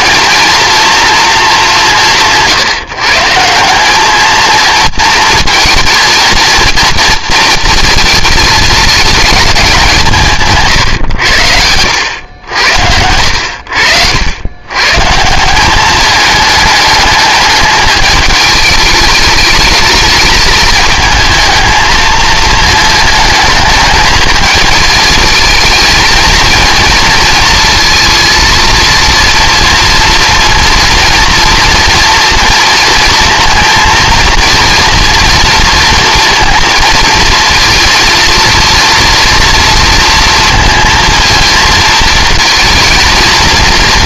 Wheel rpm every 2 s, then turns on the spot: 240, 150, 220, 230, 220, 120, 80, 130, 210, 210, 220, 220, 220, 230, 230, 230, 230, 230, 230, 230, 230, 230.
none